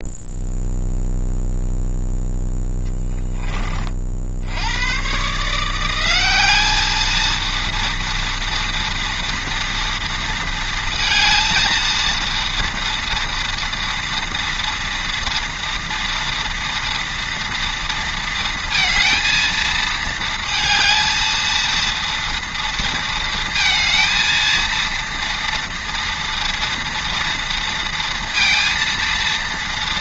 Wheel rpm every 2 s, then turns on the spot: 0, 10, 70, 190, 230, 230, 230, 230, 230, 230, 220, 230, 230, 230, 230.
none